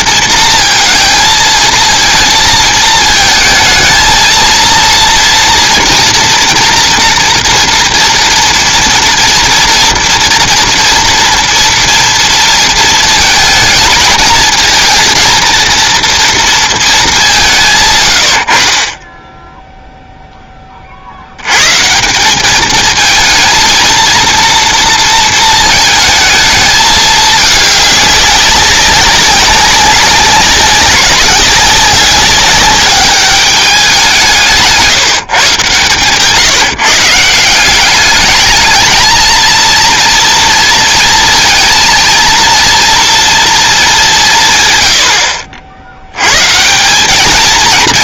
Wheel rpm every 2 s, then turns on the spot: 230, 230, 230, 230, 230, 230, 230, 220, 230, 40, 20, 210, 230, 220, 190, 200, 200, 160, 160, 210, 230, 230, 120, 170.
none